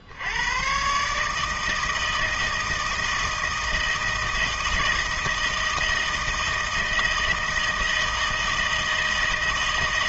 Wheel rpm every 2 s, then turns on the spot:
130, 160, 160, 160, 160.
none